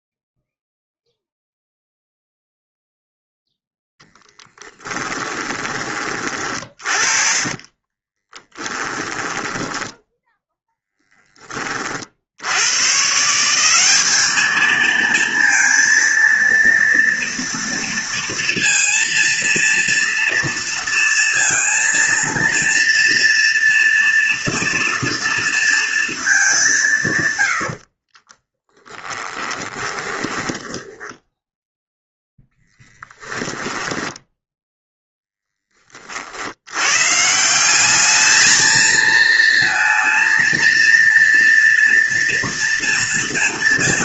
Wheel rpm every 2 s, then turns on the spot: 0, 0, 10, 30, 10, 10, 140, 220, 230, 230, 230, 230, 230, 150, 10, 10, 10, 0, 130, 230, 230, 230.
4-10 28-32